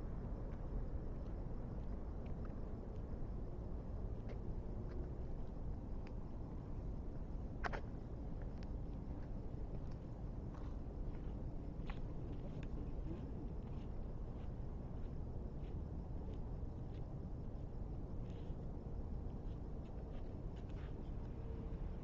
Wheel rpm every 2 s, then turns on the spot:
0, 0, 0, 0, 0, 0, 0, 0, 0, 0, 0.
none